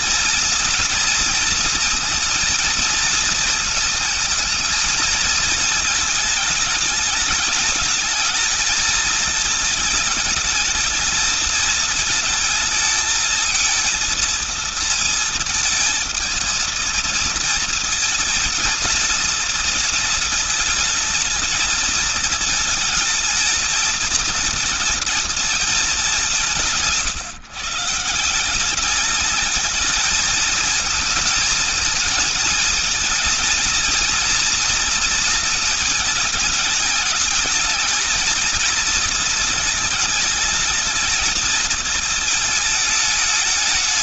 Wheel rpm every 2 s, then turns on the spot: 230, 230, 220, 220, 220, 220, 220, 220, 230, 220, 220, 220, 210, 160, 220, 220, 230, 230, 220, 220, 220, 210.
none